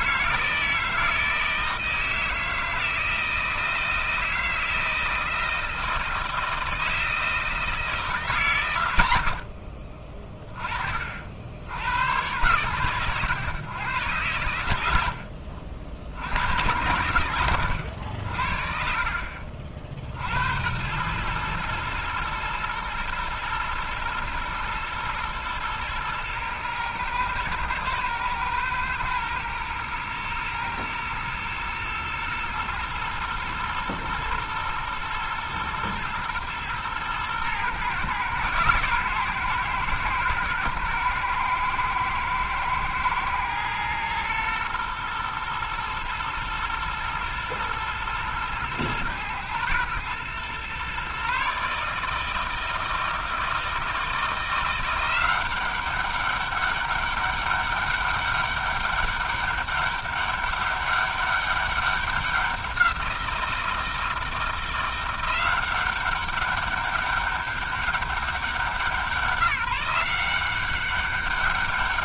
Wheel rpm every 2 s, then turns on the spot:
160, 160, 160, 160, 130, 30, 110, 90, 90, 60, 90, 110, 120, 110, 110, 110, 110, 110, 110, 130, 110, 110, 120, 110, 120, 120, 160, 170, 200, 200, 200, 180, 170, 200, 180, 190.
18-20